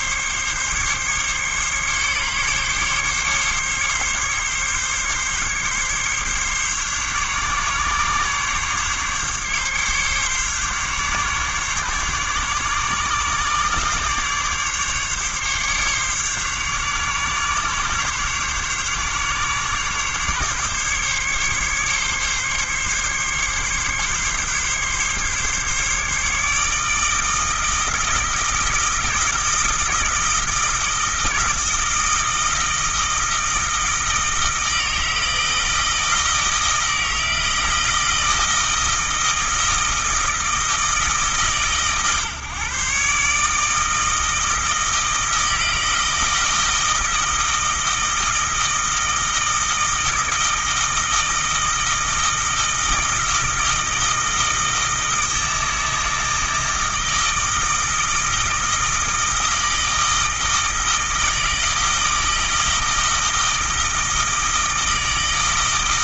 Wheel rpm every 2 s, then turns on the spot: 140, 140, 140, 140, 140, 140, 140, 140, 140, 140, 140, 140, 140, 150, 160, 160, 160, 160, 160, 160, 160, 140, 160, 160, 160, 160, 160, 160, 160, 160, 160, 160, 160.
none